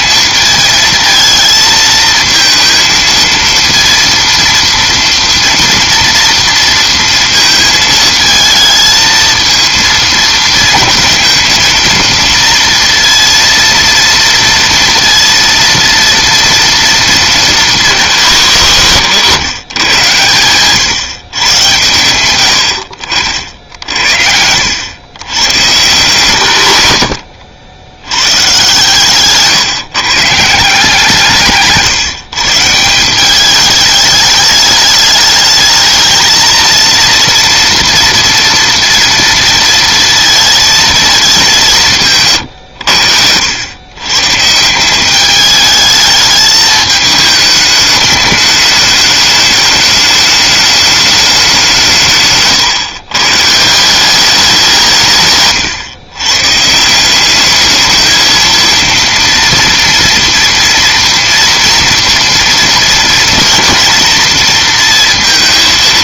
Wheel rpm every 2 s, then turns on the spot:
220, 230, 230, 230, 220, 230, 230, 230, 230, 120, 130, 80, 90, 100, 140, 160, 160, 210, 230, 230, 220, 110, 170, 210, 210, 210, 130, 190, 150, 230, 230, 230, 230.
none